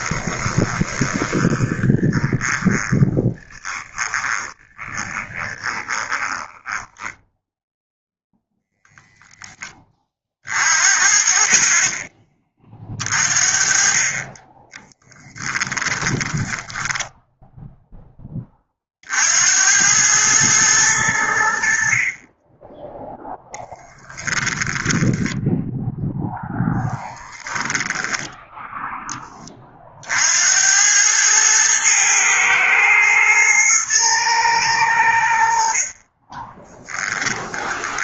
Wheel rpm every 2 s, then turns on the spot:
10, 20, 20, 10, 0, 50, 40, 10, 10, 50, 100, 10, 10, 10, 10, 100, 110, 90, 10.
0-8 14-18 24-28 36-38